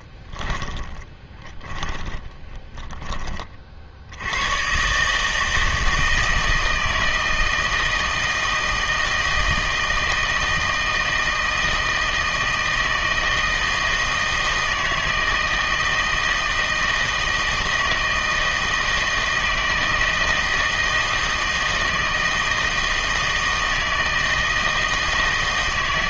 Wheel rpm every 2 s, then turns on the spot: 20, 20, 120, 160, 160, 160, 160, 160, 160, 160, 160, 160, 160.
0-4